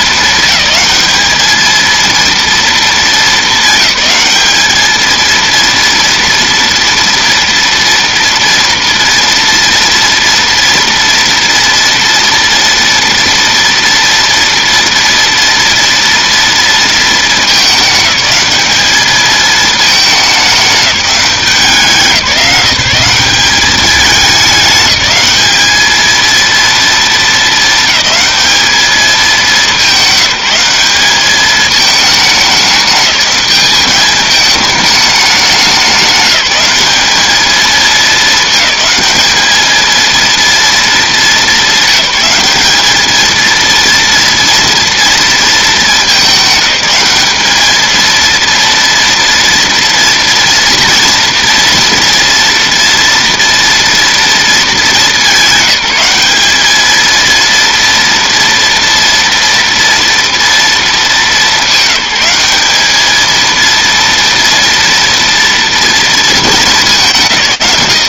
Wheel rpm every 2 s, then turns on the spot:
200, 210, 220, 230, 230, 230, 230, 230, 230, 210, 190, 170, 210, 230, 210, 190, 210, 210, 200, 220, 230, 220, 230, 210, 230, 230, 230, 210, 220, 230, 220, 210, 230, 200.
none